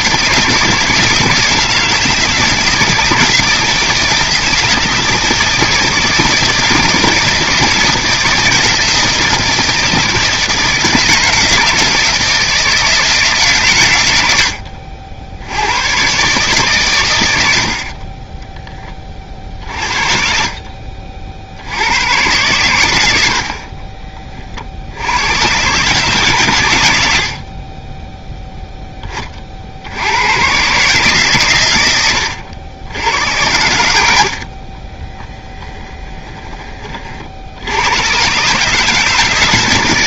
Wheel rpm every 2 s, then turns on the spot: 170, 160, 160, 160, 160, 160, 160, 80, 120, 20, 50, 110, 70, 110, 10, 140, 90, 40, 30, 150.
34-36